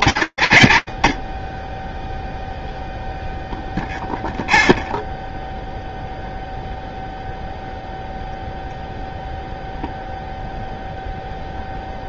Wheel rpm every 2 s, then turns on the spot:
40, 0, 0, 0, 0, 0.
none